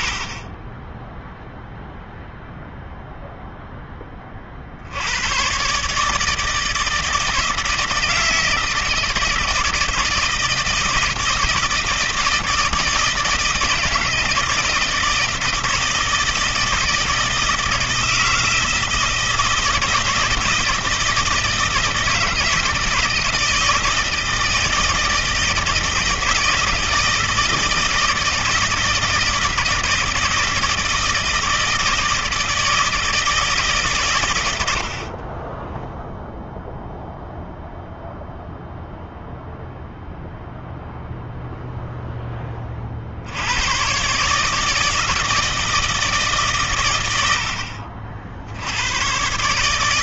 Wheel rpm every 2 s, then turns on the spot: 30, 0, 50, 160, 160, 170, 170, 160, 160, 160, 160, 160, 160, 160, 160, 160, 160, 90, 0, 0, 0, 20, 150, 130, 70.
none